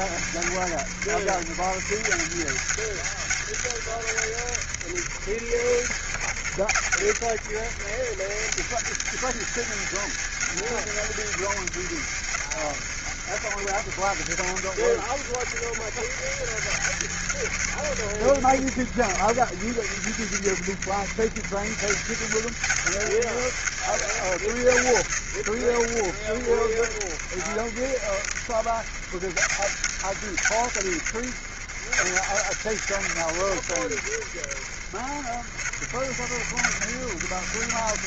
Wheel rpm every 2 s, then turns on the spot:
70, 90, 80, 70, 90, 100, 80, 80, 90, 70, 80, 90, 80, 60, 70, 80, 90, 60, 70.
none